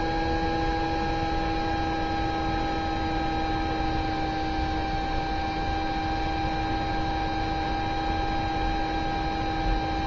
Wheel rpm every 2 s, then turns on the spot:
0, 0, 0, 0, 0.
none